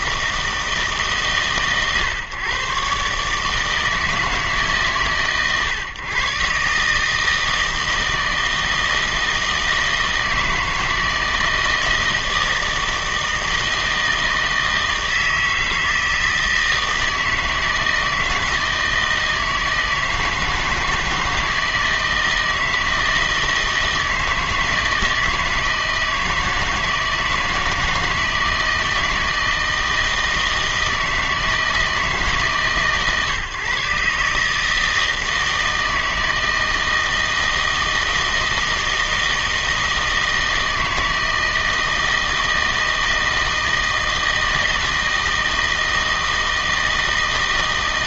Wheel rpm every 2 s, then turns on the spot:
160, 130, 150, 140, 160, 160, 160, 160, 160, 160, 160, 160, 160, 160, 160, 160, 150, 150, 160, 160, 160, 160, 160, 160.
none